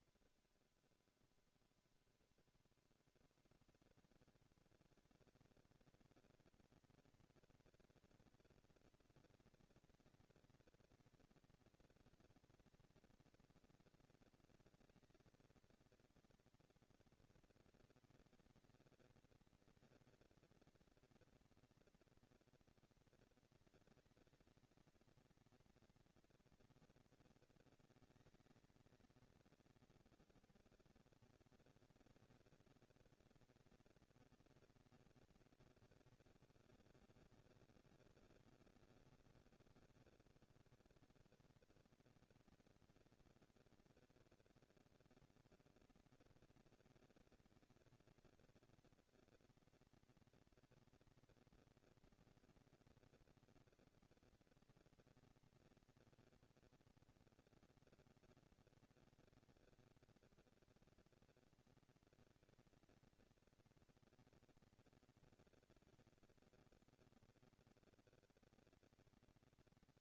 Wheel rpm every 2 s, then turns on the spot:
30, 20, 170, 230, 230, 230, 230, 230, 230, 230, 230, 230, 220, 230, 220, 210, 230, 230, 180, 190, 200, 230, 230, 230, 220, 230, 230, 230, 230, 230, 230, 230, 230, 230, 230.
none